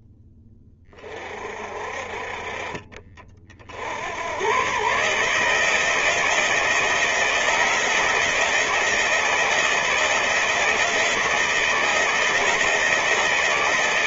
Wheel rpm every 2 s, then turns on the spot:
20, 40, 130, 170, 170, 160, 170.
none